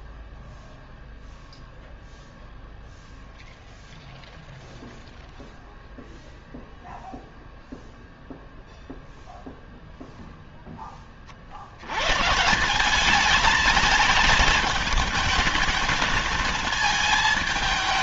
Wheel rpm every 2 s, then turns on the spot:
0, 0, 0, 0, 0, 0, 160, 220, 220.
none